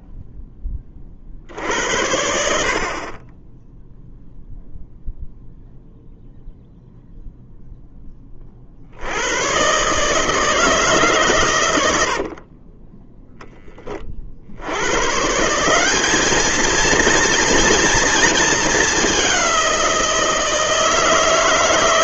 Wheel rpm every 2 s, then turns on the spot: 20, 40, 0, 0, 60, 150, 20, 90, 220, 210, 160.
12-14